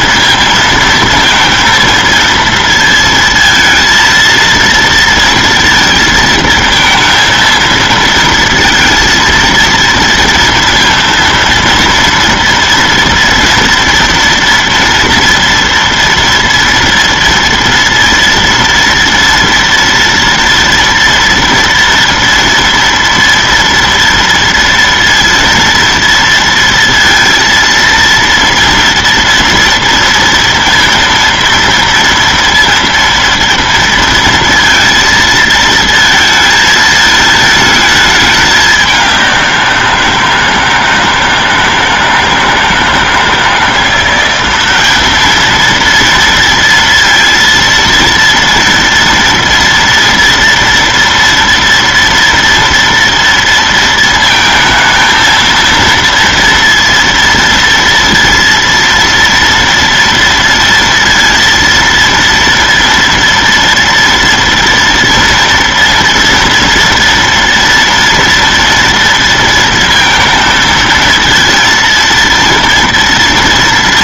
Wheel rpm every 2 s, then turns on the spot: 230, 230, 230, 230, 230, 230, 230, 230, 230, 230, 230, 230, 230, 230, 230, 230, 230, 230, 220, 200, 160, 160, 200, 230, 230, 230, 230, 220, 230, 230, 230, 230, 230, 230, 230, 220, 230.
none